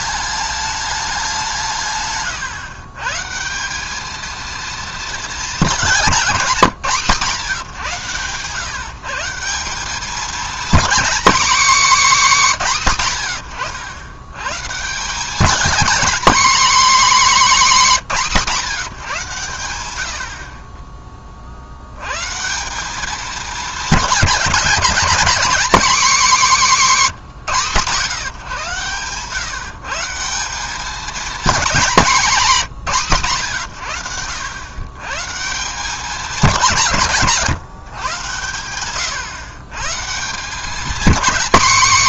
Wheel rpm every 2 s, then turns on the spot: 210, 130, 230, 180, 130, 240, 240, 130, 260, 180, 40, 160, 220, 230, 120, 190, 190, 100, 190, 100, 180.
none